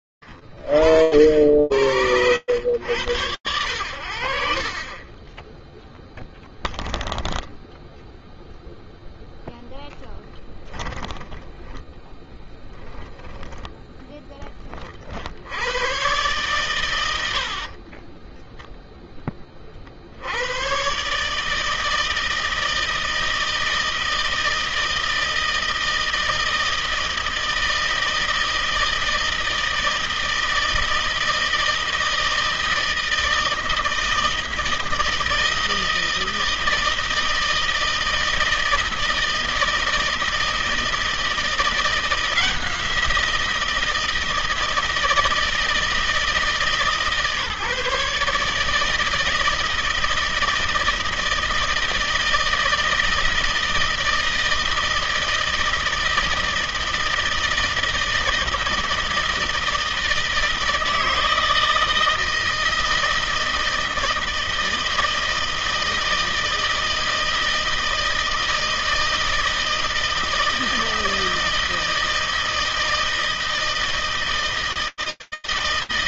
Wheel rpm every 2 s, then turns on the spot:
50, 80, 10, 0, 0, 10, 10, 110, 30, 70, 160, 160, 160, 160, 160, 160, 160, 160, 160, 160, 170, 160, 160, 150, 160, 160, 160, 160, 160, 160, 160, 160, 160, 160, 160, 160, 160, 160.
10-12 16-18